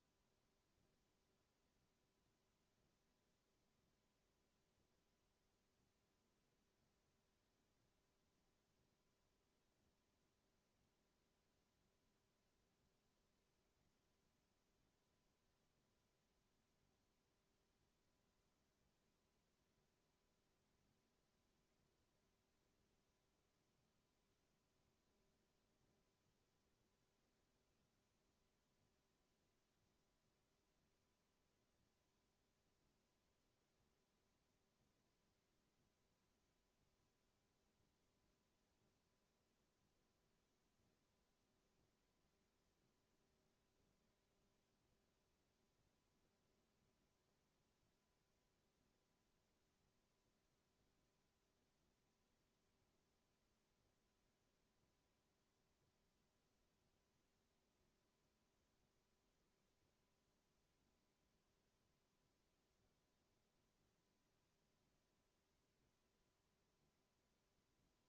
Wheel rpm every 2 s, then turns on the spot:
0, 0, 0, 0, 0, 0, 0, 0, 0, 0, 0, 0, 0, 0, 0, 0, 0, 0, 0, 0, 0, 0, 0, 0, 0, 0, 0, 0, 0, 0, 0, 0, 0, 0.
none